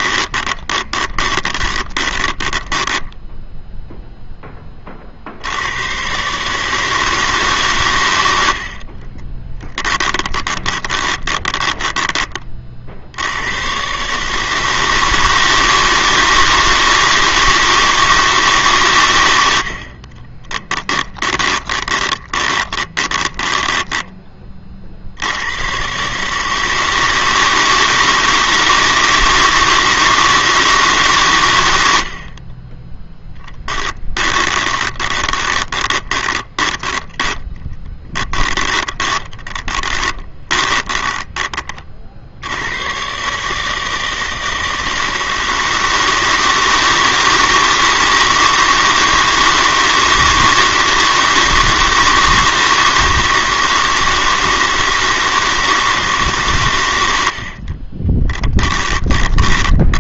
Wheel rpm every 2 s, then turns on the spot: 20, 10, 30, 150, 50, 20, 60, 160, 160, 130, 20, 20, 60, 160, 160, 140, 10, 20, 10, 10, 30, 120, 160, 160, 160, 160, 160, 160, 90, 20.
0-4 8-12 20-24 34-42 58-60